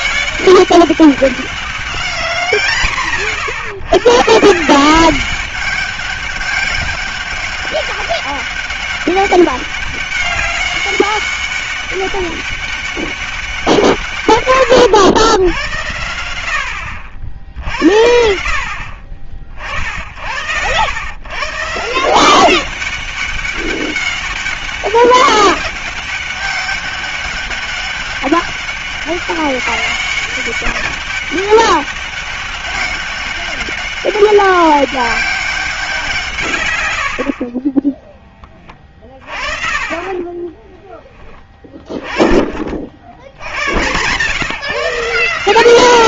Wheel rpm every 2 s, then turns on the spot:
200, 180, 160, 200, 200, 200, 200, 110, 80, 60, 90, 190, 200, 200, 200, 200, 200, 200, 130, 20, 20, 50, 160.
40-42